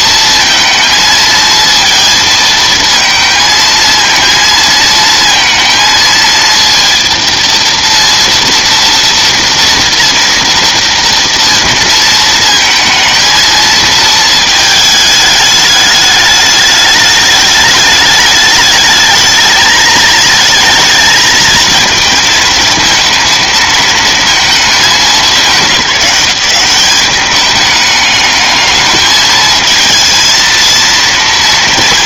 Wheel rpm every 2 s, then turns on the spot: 220, 220, 230, 230, 230, 230, 230, 210, 210, 220, 220, 220, 200, 200, 220, 230.
none